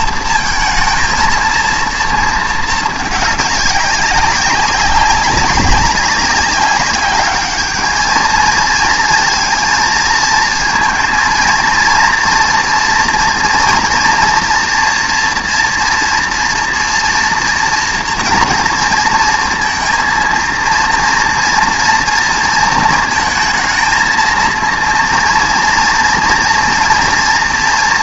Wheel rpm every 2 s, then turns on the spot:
230, 220, 200, 190, 220, 230, 230, 230, 240, 230, 230, 230, 230, 230.
none